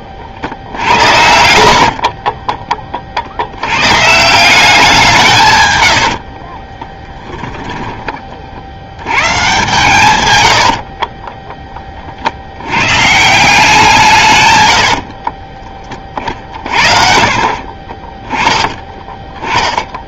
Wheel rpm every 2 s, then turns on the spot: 70, 20, 180, 20, 60, 80, 100, 90, 50, 10.
0-2 6-8 10-12 14-16